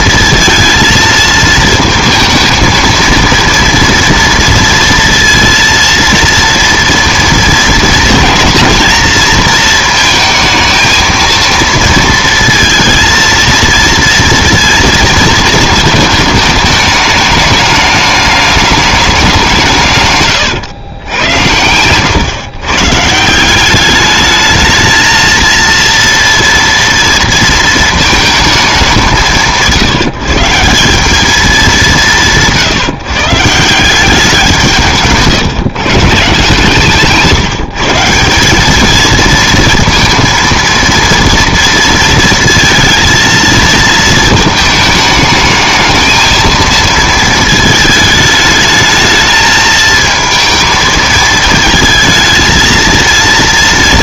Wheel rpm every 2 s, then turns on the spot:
230, 220, 230, 230, 220, 220, 230, 230, 210, 210, 110, 130, 220, 230, 210, 170, 160, 170, 150, 200, 230, 220, 220, 220, 210, 220, 230.
none